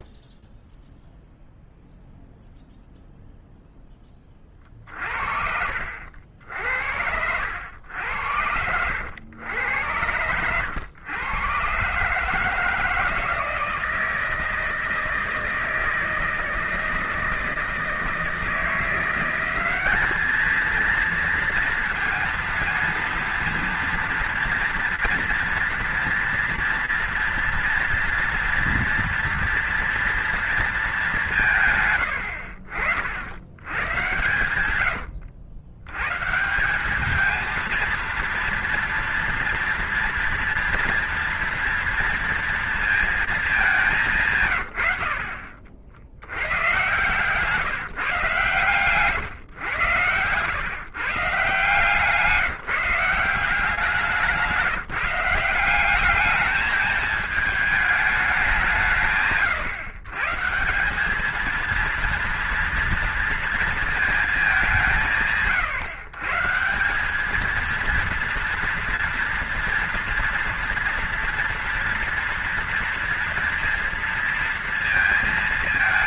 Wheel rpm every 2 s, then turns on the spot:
0, 0, 40, 80, 80, 100, 150, 160, 160, 160, 220, 230, 230, 230, 230, 230, 70, 100, 170, 230, 230, 230, 110, 120, 140, 120, 160, 180, 210, 180, 170, 230, 200, 160, 230, 230, 230, 230.
none